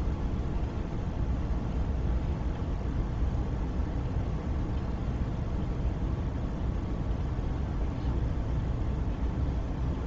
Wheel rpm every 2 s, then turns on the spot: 0, 0, 0, 0, 0.
none